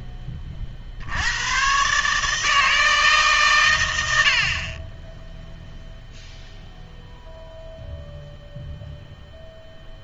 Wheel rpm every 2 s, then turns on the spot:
50, 160, 30, 0, 0.
none